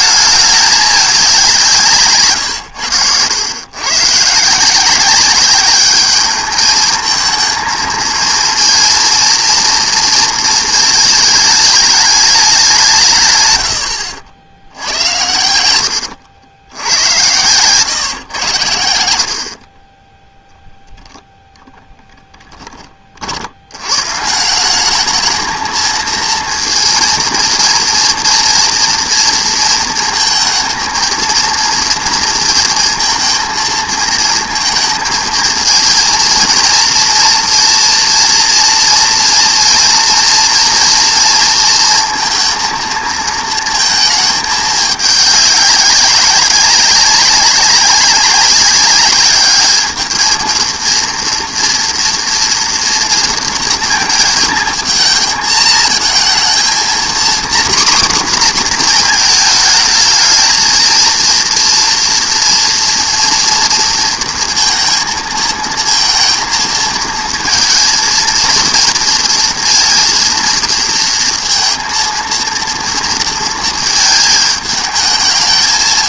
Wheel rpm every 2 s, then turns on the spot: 210, 120, 150, 220, 230, 230, 200, 70, 90, 90, 0, 10, 180, 230, 230, 230, 230, 220, 230, 230, 230, 230, 210, 200, 200, 230, 230, 220, 230, 240, 220, 230, 230, 230, 230, 230, 230, 220.
none